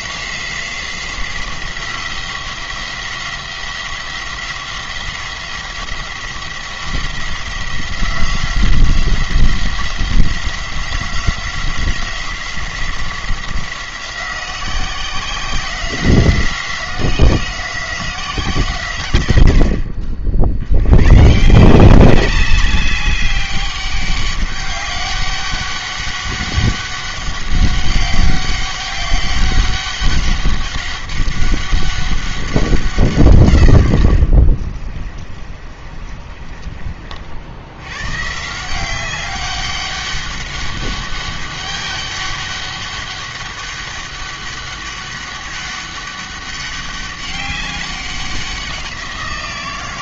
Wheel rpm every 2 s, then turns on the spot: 180, 180, 180, 180, 180, 180, 180, 180, 180, 140, 90, 200, 200, 190, 200, 200, 180, 30, 40, 180, 200, 200, 200, 200, 180.
34-36